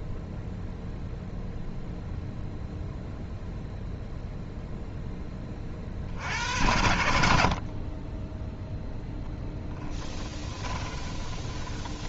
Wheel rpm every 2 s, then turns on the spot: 0, 0, 0, 70, 0, 20.
10-12